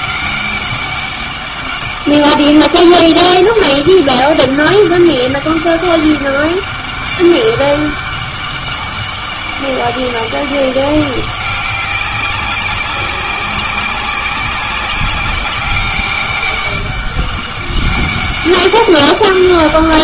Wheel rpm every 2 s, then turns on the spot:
200, 200, 200, 200, 200, 200, 190, 190, 200, 200.
none